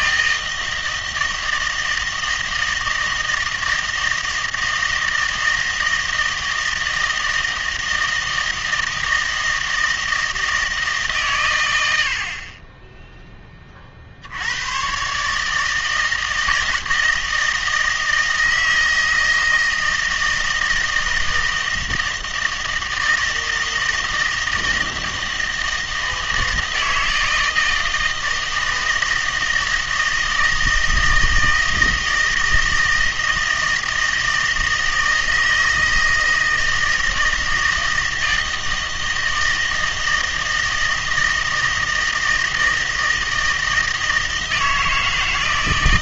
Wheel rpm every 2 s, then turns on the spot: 160, 160, 160, 160, 160, 150, 10, 110, 160, 160, 160, 160, 160, 160, 160, 160, 160, 160, 160, 160, 160, 160, 160.
none